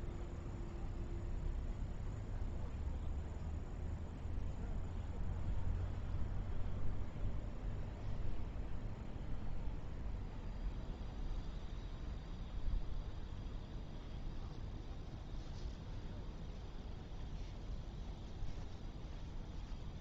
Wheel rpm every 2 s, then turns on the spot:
0, 0, 0, 0, 0, 0, 0, 0, 0, 0.
none